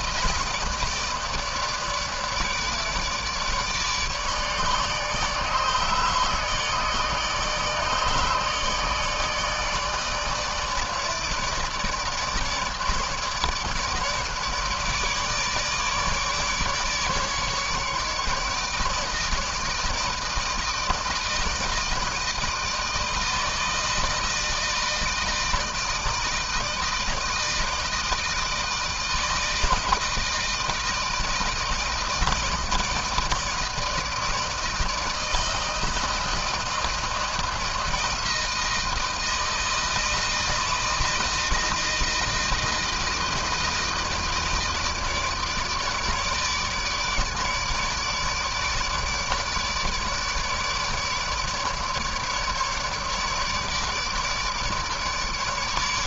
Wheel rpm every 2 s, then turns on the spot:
160, 150, 150, 150, 150, 150, 150, 160, 150, 150, 160, 160, 160, 160, 160, 160, 160, 160, 160, 160, 160, 160, 160, 150, 150, 150, 150, 150.
none